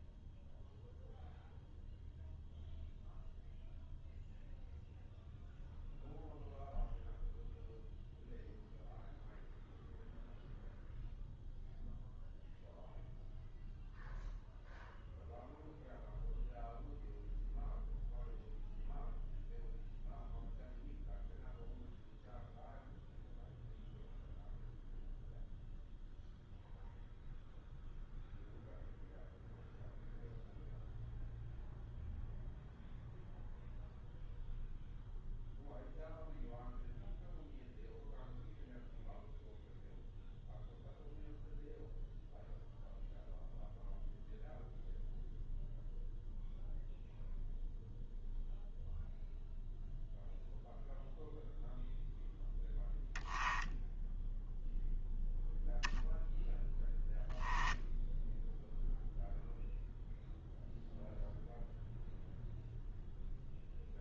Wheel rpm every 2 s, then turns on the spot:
0, 0, 0, 0, 0, 0, 0, 0, 0, 0, 0, 0, 0, 0, 0, 0, 0, 0, 0, 0, 0, 0, 0, 0, 0, 0, 0, 0, 0, 0, 0, 0.
none